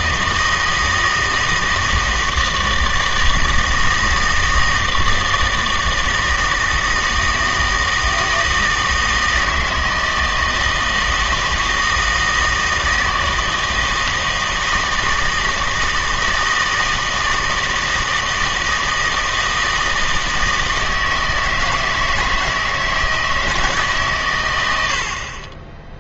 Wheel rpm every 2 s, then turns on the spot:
160, 160, 160, 160, 160, 160, 160, 160, 160, 160, 160, 160, 110.
none